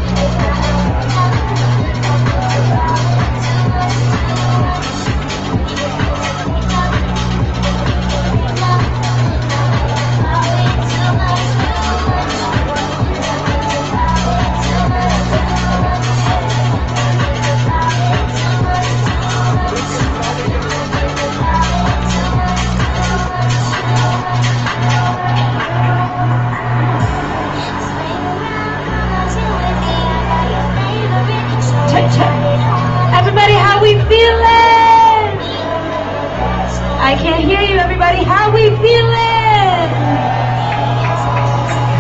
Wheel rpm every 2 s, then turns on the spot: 0, 0, 0, 0, 0, 0, 0, 0, 0, 0, 0, 0, 0, 0, 0, 0, 0, 0, 0, 0, 0.
none